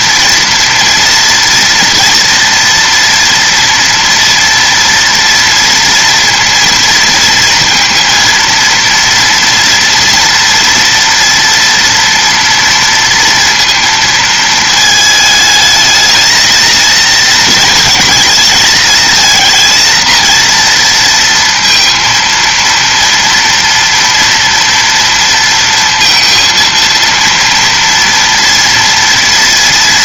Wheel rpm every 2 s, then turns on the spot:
230, 230, 230, 230, 230, 230, 230, 220, 220, 220, 230, 230, 230, 230, 230.
none